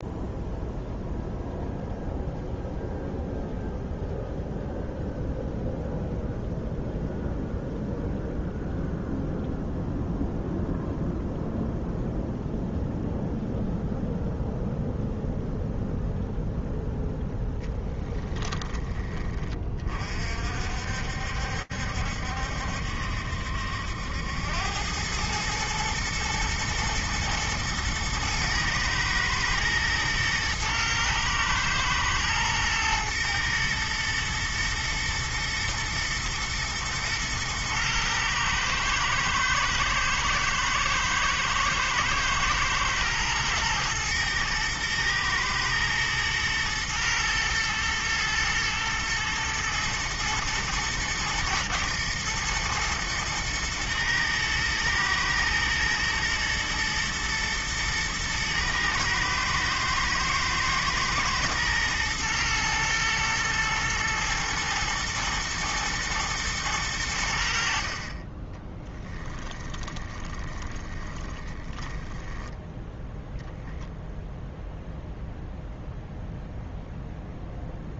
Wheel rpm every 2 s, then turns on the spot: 0, 0, 0, 0, 0, 0, 0, 0, 0, 10, 60, 70, 90, 110, 110, 110, 110, 110, 110, 110, 110, 110, 120, 110, 110, 110, 110, 110, 120, 110, 110, 110, 110, 100, 20, 20, 10, 0, 0.
68-72